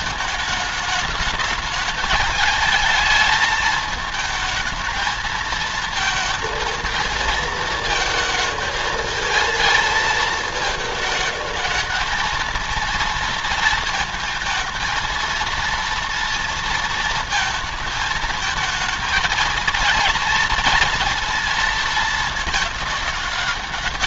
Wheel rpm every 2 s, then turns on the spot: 220, 220, 220, 220, 220, 220, 230, 220, 230, 220, 230, 210.
none